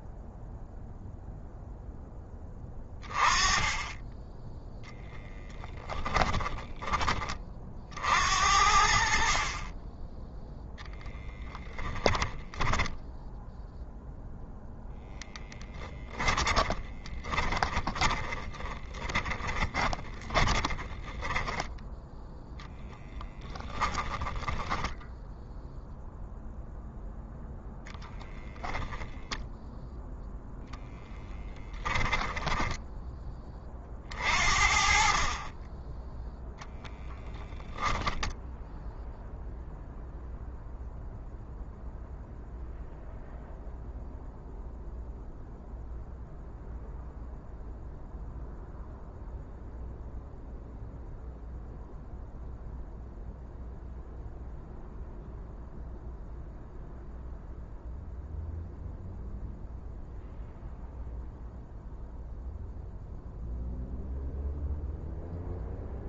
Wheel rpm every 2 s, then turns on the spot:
0, 20, 0, 20, 60, 0, 10, 0, 20, 30, 10, 10, 10, 0, 10, 0, 10, 40, 10, 0, 0, 0, 0, 0, 0, 0, 0, 0, 0, 0, 0, 0, 0.
16-24 28-30